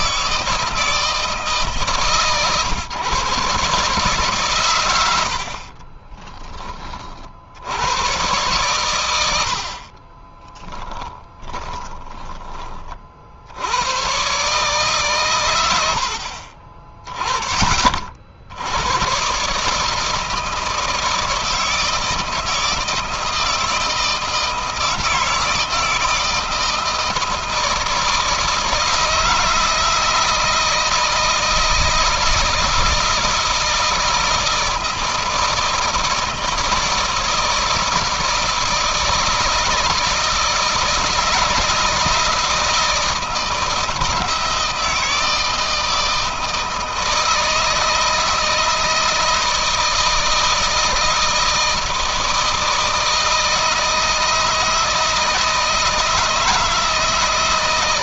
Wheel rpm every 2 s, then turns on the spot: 160, 130, 120, 40, 120, 20, 40, 140, 30, 100, 160, 160, 160, 160, 160, 160, 160, 160, 160, 170, 170, 160, 160, 160, 160, 160, 160, 160, 160.
10-12